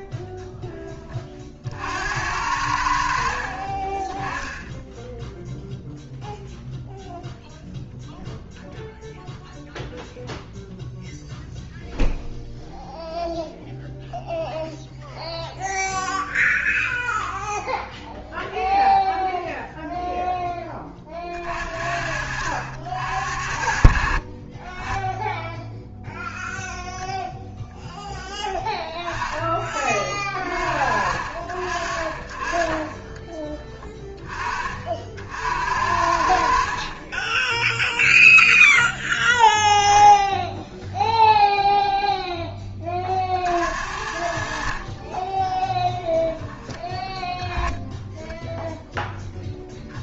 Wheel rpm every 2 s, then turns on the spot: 20, 80, 10, 0, 0, 0, 0, 0, 0, 0, 20, 70, 20, 0, 10, 40, 40, 40, 50, 0, 0, 20, 50, 10, 0.
none